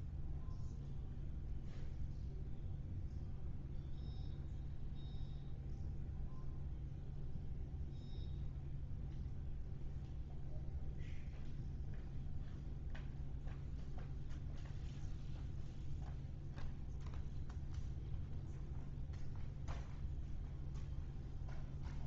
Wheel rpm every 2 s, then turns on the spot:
0, 0, 0, 0, 0, 0, 0, 0, 0, 0, 0.
none